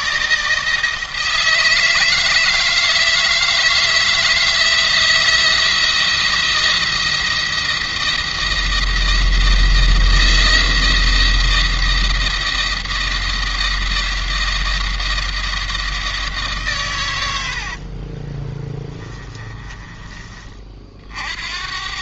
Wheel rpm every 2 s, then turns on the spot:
160, 160, 160, 170, 170, 170, 170, 170, 130, 20, 40.
18-20